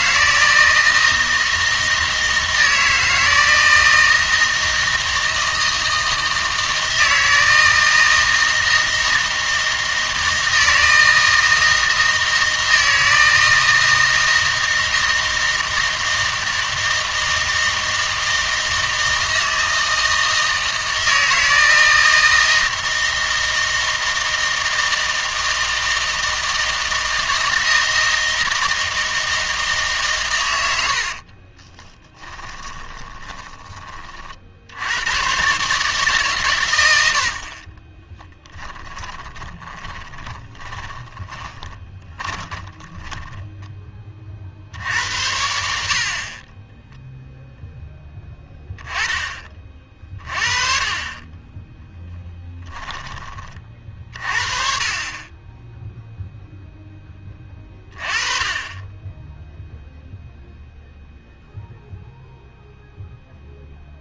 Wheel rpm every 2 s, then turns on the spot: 160, 160, 160, 160, 160, 160, 160, 160, 160, 160, 160, 160, 160, 160, 160, 80, 20, 80, 120, 10, 10, 10, 60, 20, 10, 30, 10, 40, 10, 20, 0, 0.
30-34 38-44 46-48 52-54